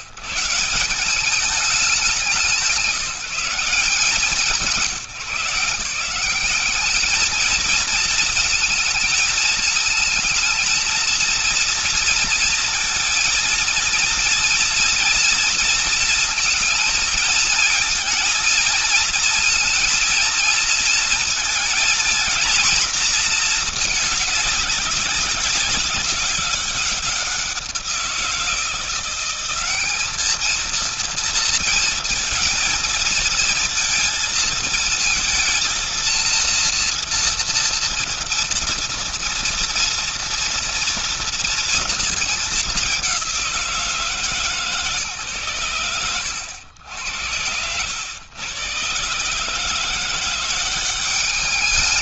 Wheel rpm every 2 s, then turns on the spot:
120, 170, 170, 200, 220, 230, 230, 230, 230, 230, 230, 230, 200, 190, 170, 220, 220, 230, 230, 230, 230, 200, 150, 80, 110, 180.
none